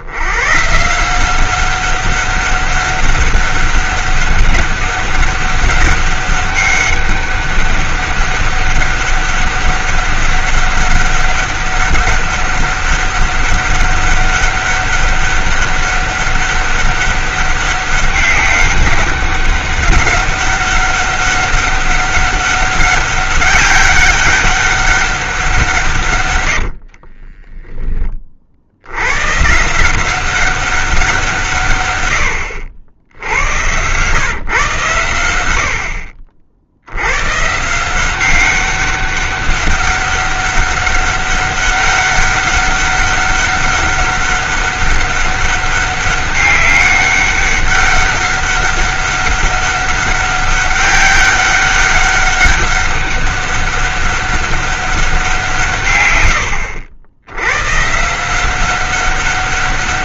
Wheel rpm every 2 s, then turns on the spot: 130, 200, 200, 200, 200, 200, 200, 200, 200, 200, 200, 200, 200, 70, 80, 190, 70, 120, 80, 200, 200, 200, 200, 200, 200, 200, 200, 200, 80, 180.
26-28 56-58